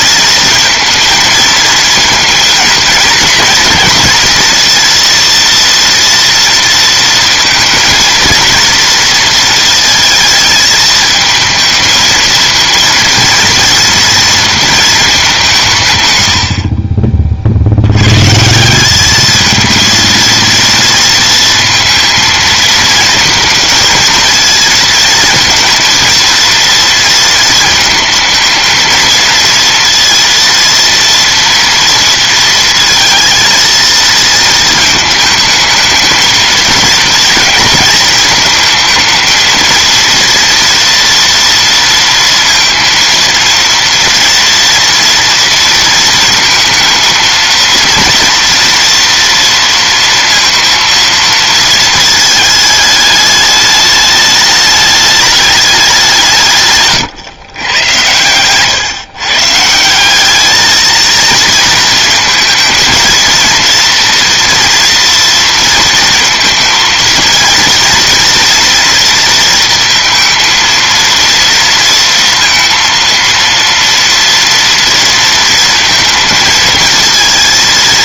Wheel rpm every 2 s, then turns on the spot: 230, 230, 230, 230, 230, 220, 230, 230, 60, 170, 230, 220, 230, 230, 220, 230, 230, 220, 220, 220, 230, 230, 230, 230, 240, 230, 220, 210, 150, 120, 220, 230, 240, 230, 230, 230, 230, 230, 230.
none